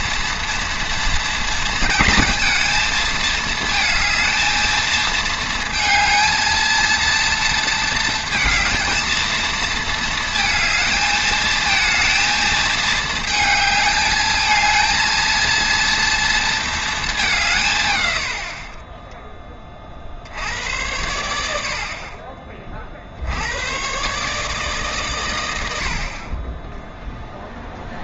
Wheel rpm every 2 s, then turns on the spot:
230, 230, 230, 230, 230, 220, 220, 220, 230, 40, 80, 40, 150, 10.
none